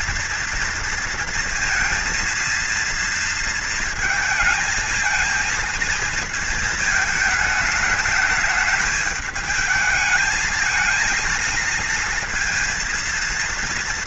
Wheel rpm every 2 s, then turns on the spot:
230, 230, 230, 220, 210, 220, 230.
none